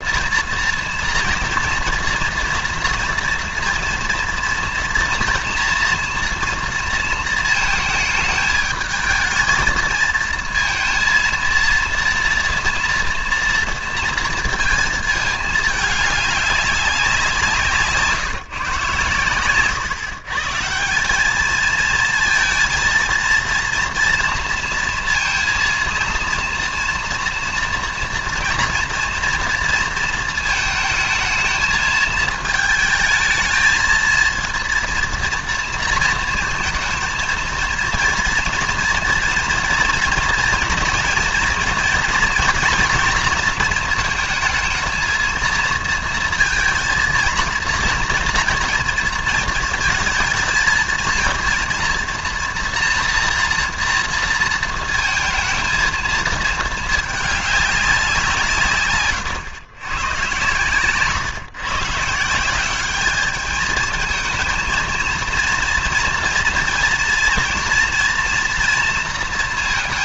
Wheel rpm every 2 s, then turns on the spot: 230, 230, 230, 230, 210, 230, 230, 230, 200, 150, 150, 230, 230, 230, 230, 230, 220, 230, 220, 230, 230, 230, 220, 230, 230, 220, 230, 230, 220, 150, 140, 190, 230, 240, 230.
none